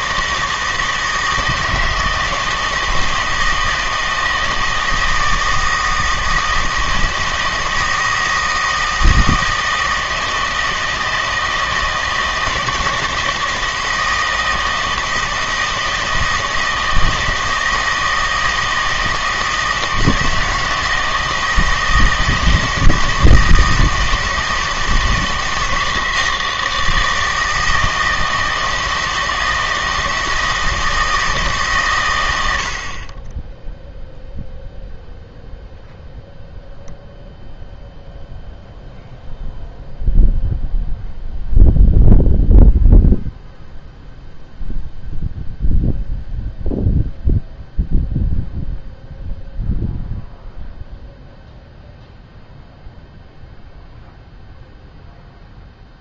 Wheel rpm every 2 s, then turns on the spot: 160, 160, 160, 160, 160, 160, 160, 160, 160, 160, 160, 160, 160, 160, 160, 160, 70, 0, 0, 0, 0, 0, 0, 0, 0, 0, 0, 0.
none